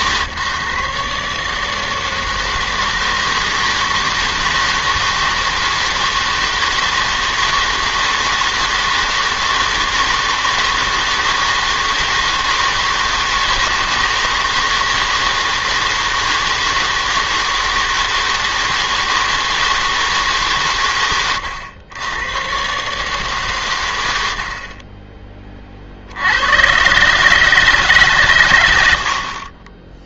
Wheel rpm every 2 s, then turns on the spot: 140, 160, 160, 160, 160, 160, 160, 160, 160, 160, 140, 130, 50, 110, 110.
none